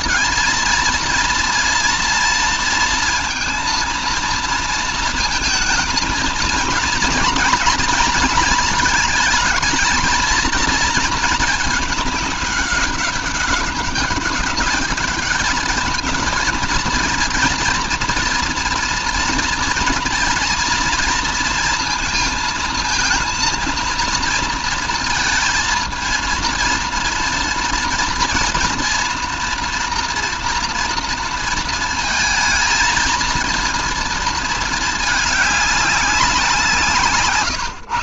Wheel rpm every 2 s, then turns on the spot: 230, 230, 230, 240, 230, 230, 200, 200, 230, 230, 230, 230, 230, 230, 240, 230, 220, 220, 180.
none